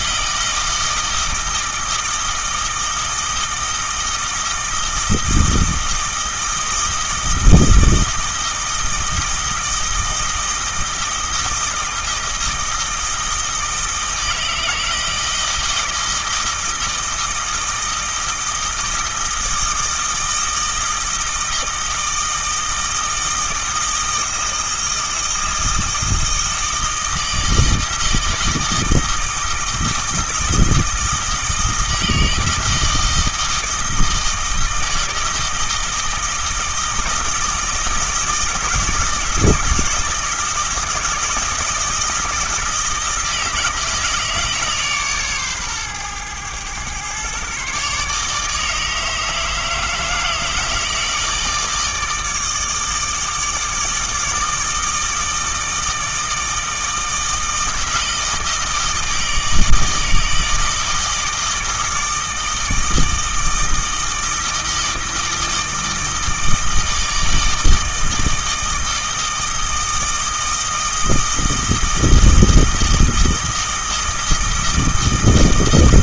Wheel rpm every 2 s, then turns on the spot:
160, 160, 160, 160, 160, 160, 160, 160, 160, 160, 160, 160, 160, 160, 160, 160, 160, 160, 160, 160, 160, 160, 150, 120, 150, 160, 160, 160, 160, 160, 160, 160, 160, 160, 160, 160, 160, 160.
none